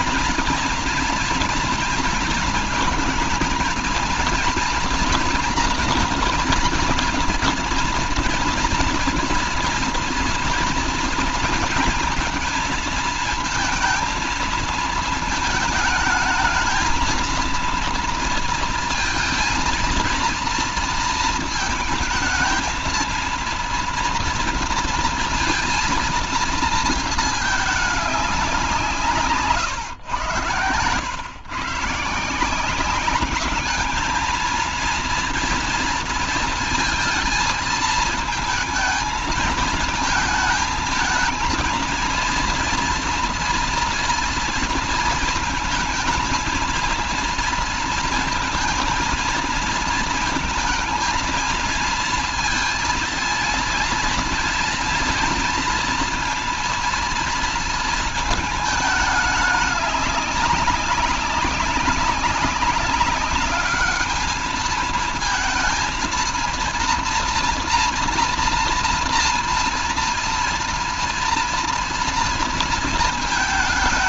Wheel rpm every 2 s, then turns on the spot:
230, 220, 230, 230, 230, 230, 230, 220, 230, 230, 230, 230, 230, 220, 160, 110, 210, 230, 230, 220, 220, 230, 230, 230, 230, 220, 230, 230, 230, 210, 200, 200, 230, 230, 230, 230, 220.
none